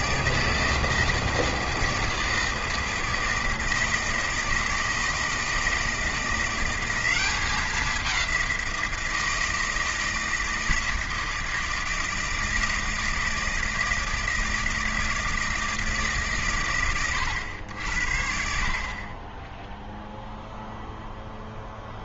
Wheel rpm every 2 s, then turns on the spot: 160, 160, 160, 170, 180, 160, 160, 160, 100, 50, 0.
none